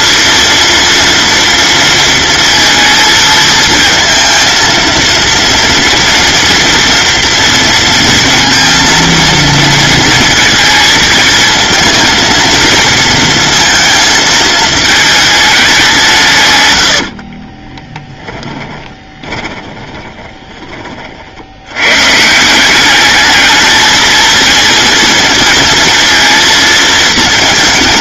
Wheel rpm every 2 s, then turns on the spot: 230, 230, 230, 230, 230, 220, 230, 220, 90, 20, 30, 200, 230, 230.
16-20